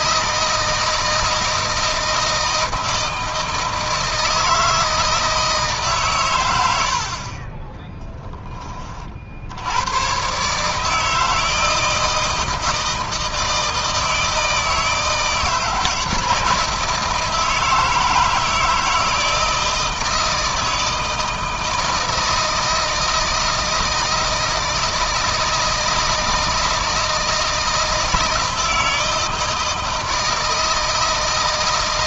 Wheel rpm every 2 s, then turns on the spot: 160, 160, 160, 90, 30, 150, 160, 160, 170, 160, 160, 160, 160, 160, 160, 160.
none